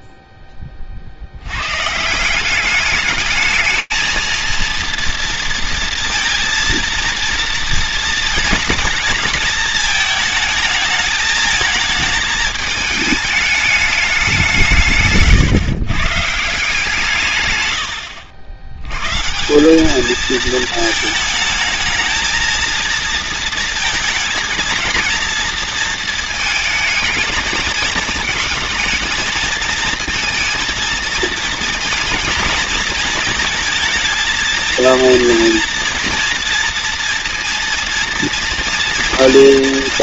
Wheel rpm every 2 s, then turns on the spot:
60, 210, 230, 230, 220, 220, 210, 130, 140, 130, 220, 230, 230, 220, 220, 230, 220, 230, 230, 240.
none